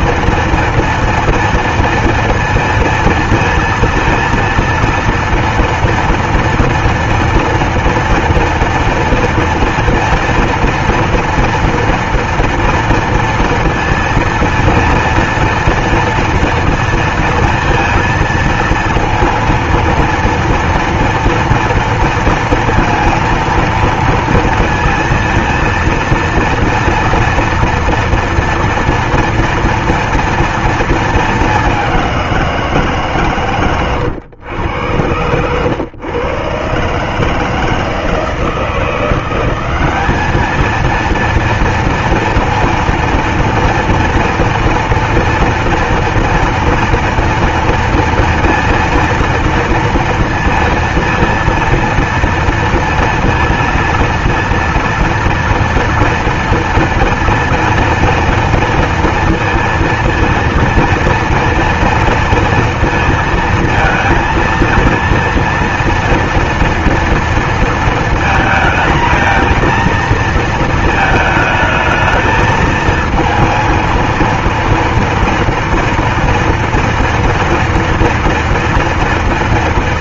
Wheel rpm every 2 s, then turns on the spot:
230, 230, 230, 230, 230, 230, 230, 230, 230, 230, 230, 230, 230, 230, 230, 230, 180, 120, 120, 160, 210, 230, 230, 230, 230, 230, 230, 230, 230, 230, 230, 230, 230, 230, 230, 230, 220, 230, 230, 230.
none